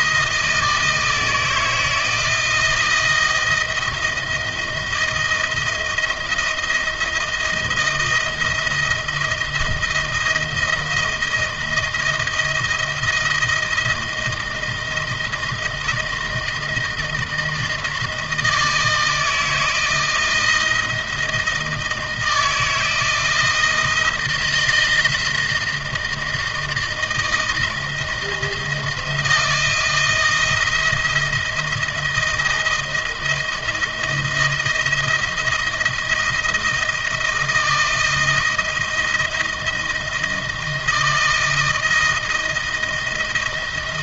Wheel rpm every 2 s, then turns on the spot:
160, 160, 170, 160, 170, 160, 170, 160, 170, 160, 160, 160, 160, 160, 170, 170, 160, 160, 160, 170, 160, 170.
none